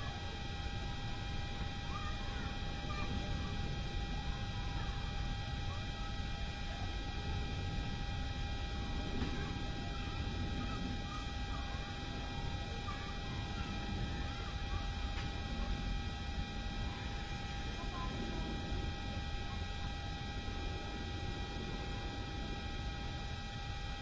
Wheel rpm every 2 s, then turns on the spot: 0, 0, 0, 0, 0, 0, 0, 0, 0, 0, 0, 0.
none